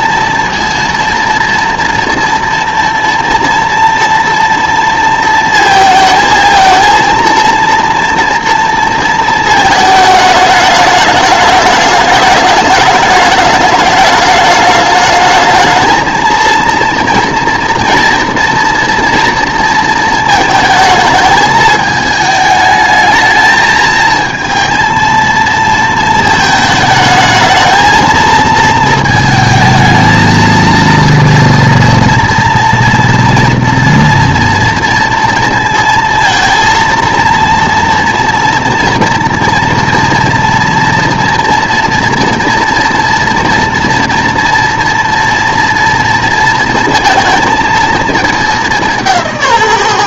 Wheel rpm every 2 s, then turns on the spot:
230, 230, 230, 230, 230, 210, 210, 210, 230, 240, 220, 220, 220, 220, 220, 230, 240, 230, 230, 230, 230, 230, 230, 230, 200.
none